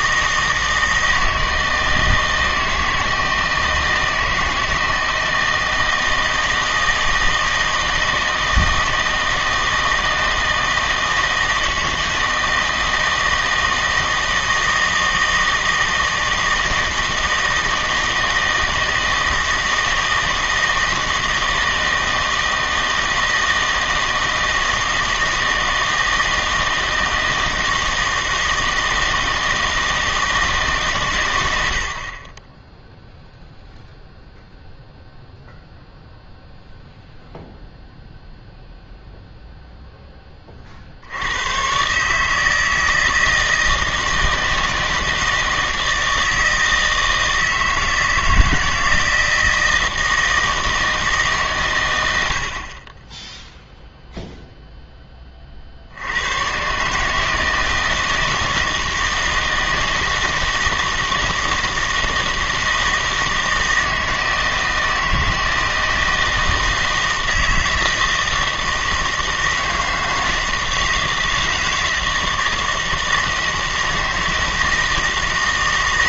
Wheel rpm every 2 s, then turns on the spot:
160, 160, 170, 160, 160, 160, 160, 160, 160, 160, 160, 160, 160, 160, 160, 110, 0, 0, 0, 0, 110, 160, 160, 160, 160, 130, 0, 20, 150, 160, 160, 160, 160, 160, 160, 160, 160, 160.
none